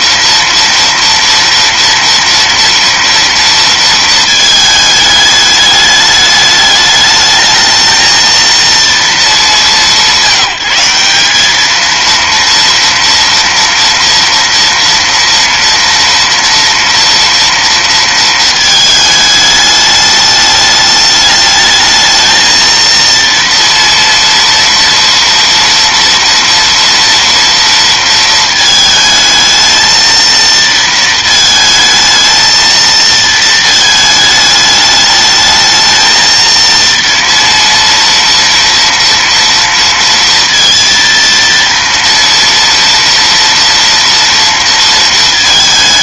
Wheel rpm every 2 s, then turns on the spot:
230, 230, 220, 210, 230, 190, 230, 230, 230, 220, 210, 230, 230, 230, 220, 230, 230, 210, 230, 230, 230, 230, 230.
none